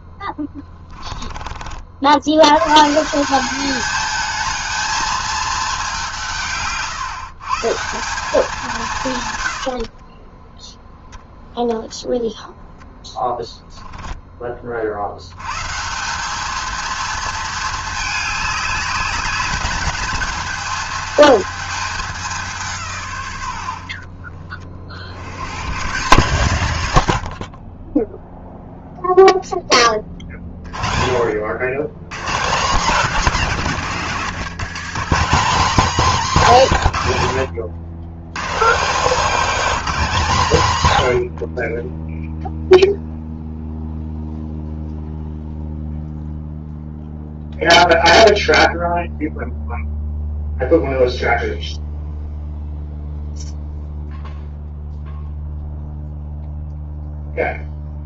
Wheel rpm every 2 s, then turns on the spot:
10, 120, 220, 140, 180, 10, 10, 40, 220, 210, 220, 160, 40, 130, 0, 40, 200, 200, 170, 150, 140, 0, 0, 0, 0, 0, 0, 0, 0.
none